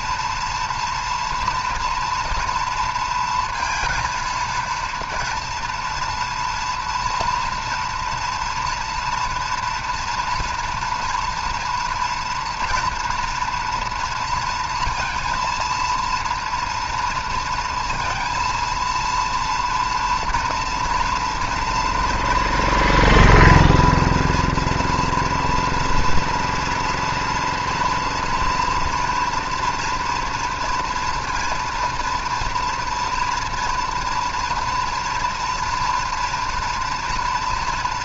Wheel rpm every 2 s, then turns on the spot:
230, 230, 230, 230, 240, 240, 230, 230, 230, 230, 230, 230, 230, 230, 230, 230, 240, 240, 240.
none